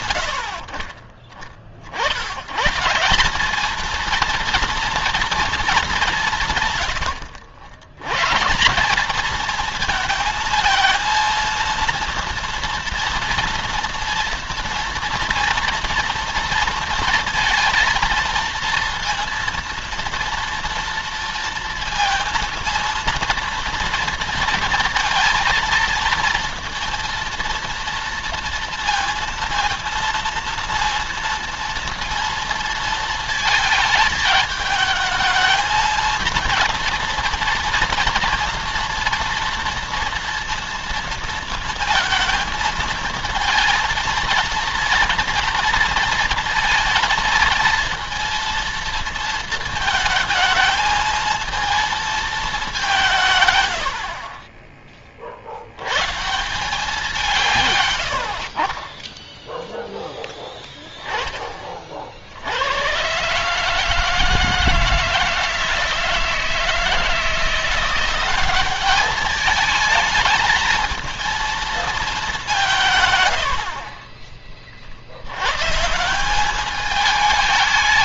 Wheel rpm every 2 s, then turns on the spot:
50, 140, 230, 120, 200, 230, 240, 240, 230, 230, 230, 230, 230, 230, 230, 230, 230, 220, 230, 230, 230, 220, 230, 230, 230, 220, 190, 30, 190, 40, 10, 90, 160, 160, 200, 220, 170, 40, 200.
none